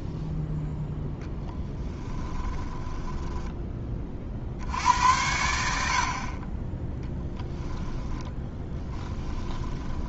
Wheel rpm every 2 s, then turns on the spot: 0, 20, 70, 20, 10.
2-4 8-10